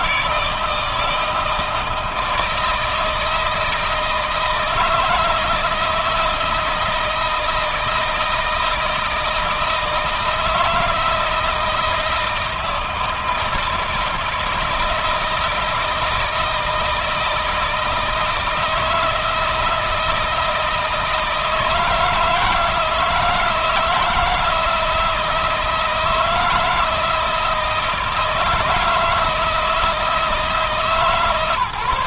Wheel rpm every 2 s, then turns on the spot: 160, 160, 160, 170, 160, 160, 160, 160, 160, 160, 160, 160, 160, 160, 160, 160.
none